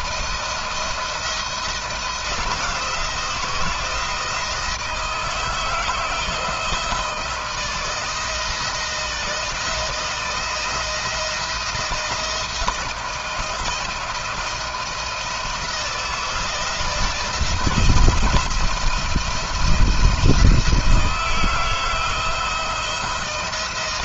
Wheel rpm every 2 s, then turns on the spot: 170, 170, 170, 160, 160, 160, 170, 170, 170, 170, 170, 170.
none